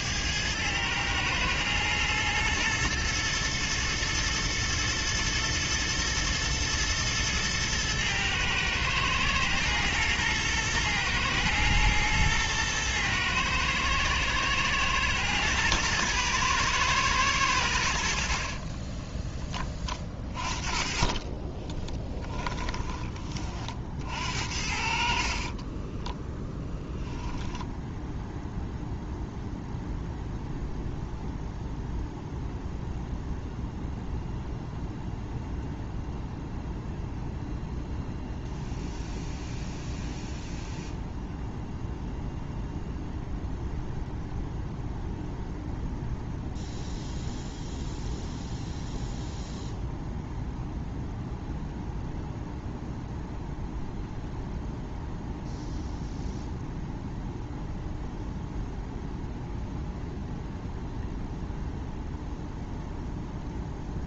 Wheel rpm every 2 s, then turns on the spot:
110, 110, 110, 110, 110, 120, 120, 120, 120, 30, 30, 20, 60, 10, 0, 0, 0, 0, 0, 0, 0, 0, 0, 0, 0, 0, 0, 0, 0, 0, 0, 0.
18-24 26-28